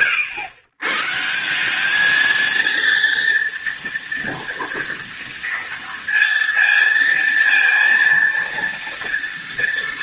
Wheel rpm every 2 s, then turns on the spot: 130, 230, 230, 230, 230.
none